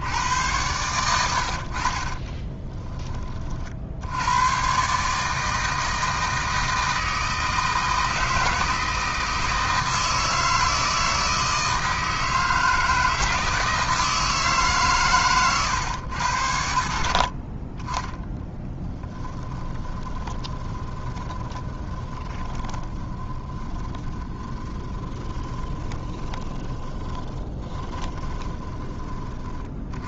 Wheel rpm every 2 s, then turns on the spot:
120, 20, 130, 160, 160, 160, 160, 140, 70, 10, 20, 20, 10, 20, 20.
2-4 18-28